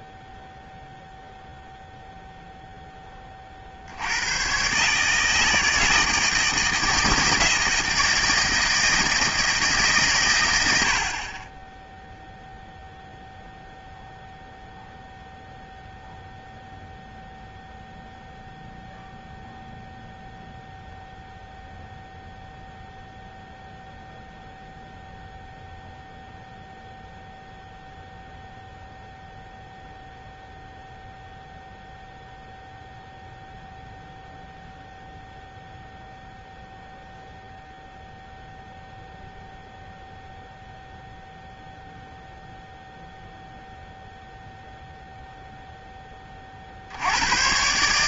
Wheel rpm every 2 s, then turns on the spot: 0, 0, 110, 160, 160, 110, 0, 0, 0, 0, 0, 0, 0, 0, 0, 0, 0, 0, 0, 0, 0, 0, 0, 40.
none